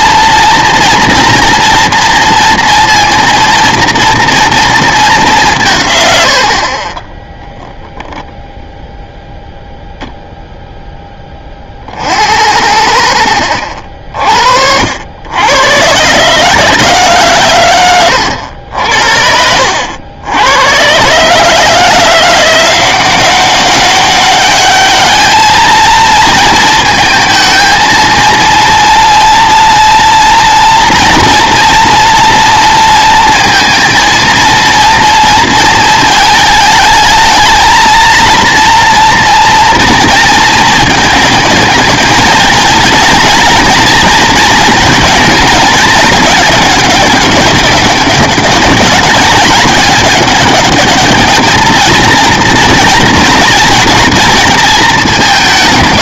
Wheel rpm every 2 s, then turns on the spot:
240, 230, 220, 40, 0, 0, 70, 70, 150, 70, 110, 180, 200, 230, 230, 230, 230, 230, 220, 230, 220, 220, 230, 200, 200, 210, 230, 210.
none